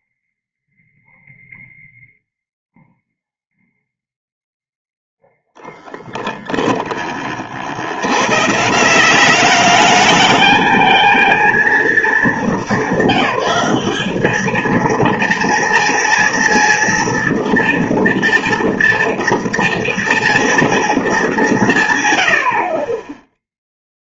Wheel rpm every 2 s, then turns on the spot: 0, 0, 0, 0, 120, 220, 210, 210, 230, 230, 230, 90.
none